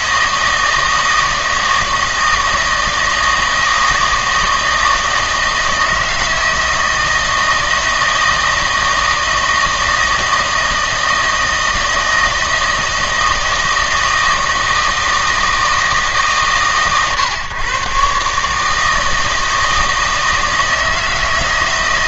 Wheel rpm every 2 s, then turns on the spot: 160, 160, 160, 160, 160, 160, 160, 160, 140, 150, 160.
none